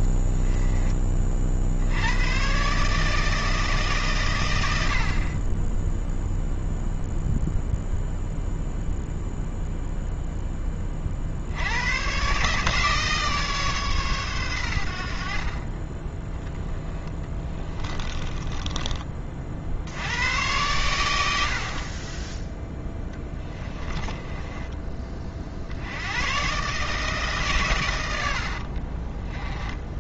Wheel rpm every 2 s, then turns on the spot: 20, 150, 80, 0, 0, 30, 150, 80, 10, 20, 110, 10, 20, 140, 50.
16-20 22-24